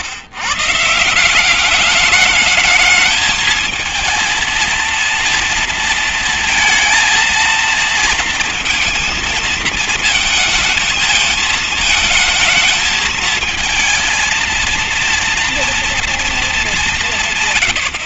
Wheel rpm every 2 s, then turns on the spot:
140, 210, 230, 230, 230, 230, 220, 230, 220.
none